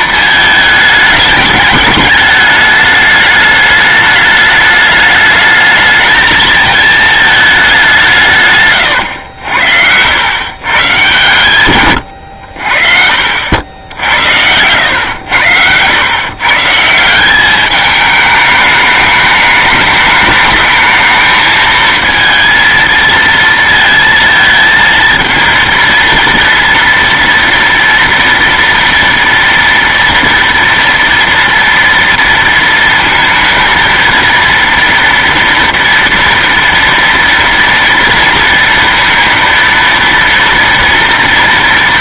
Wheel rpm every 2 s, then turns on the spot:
220, 210, 210, 220, 120, 120, 70, 90, 150, 210, 210, 230, 230, 230, 230, 230, 230, 230, 230, 230, 230.
8-10